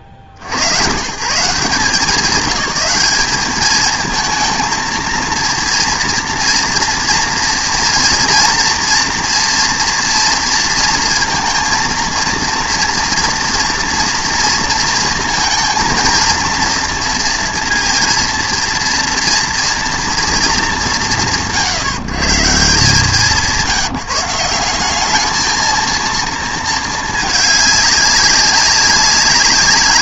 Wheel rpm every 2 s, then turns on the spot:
80, 190, 230, 230, 230, 230, 230, 230, 230, 230, 200, 160, 180, 220, 200.
none